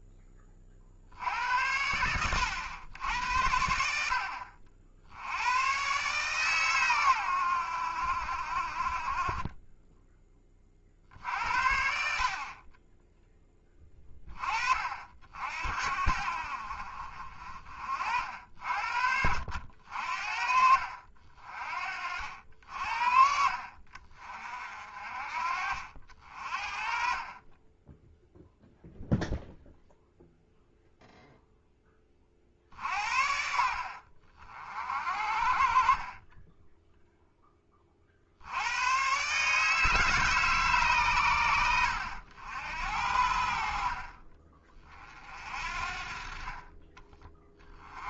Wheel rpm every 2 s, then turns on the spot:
40, 90, 60, 130, 40, 30, 30, 40, 50, 60, 50, 60, 50, 40, 0, 0, 60, 50, 10, 90, 140, 80, 30, 40.
18-20